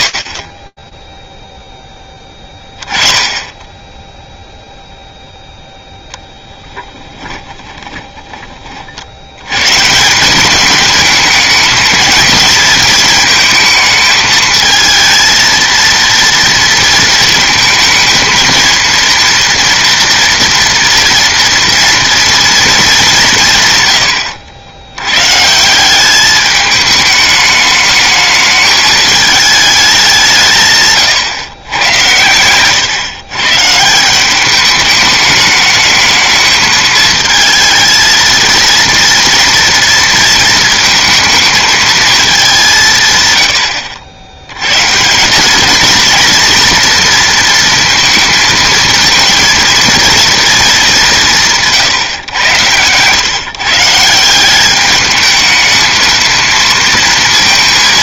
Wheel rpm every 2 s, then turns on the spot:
20, 20, 0, 10, 80, 210, 220, 220, 230, 230, 230, 190, 130, 210, 220, 120, 120, 210, 220, 230, 220, 110, 180, 230, 230, 180, 130, 210, 230.
6-8 30-32